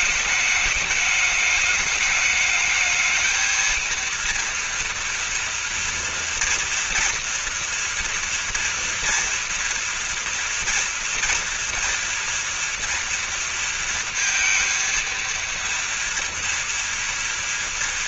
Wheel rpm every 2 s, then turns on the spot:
210, 220, 230, 230, 240, 240, 240, 230, 230.
none